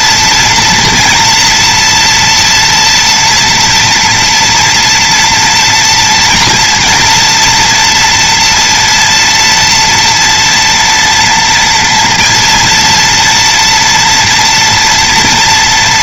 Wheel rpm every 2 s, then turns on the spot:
230, 240, 240, 230, 230, 230, 230, 240.
none